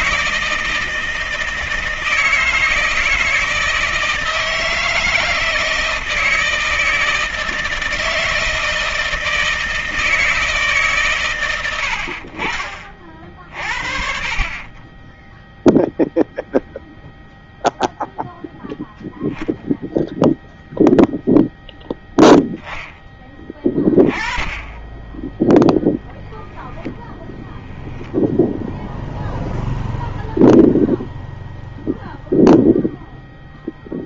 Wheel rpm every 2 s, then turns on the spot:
160, 160, 160, 160, 160, 130, 30, 10, 0, 0, 0, 10, 10, 0, 0, 0, 0.
none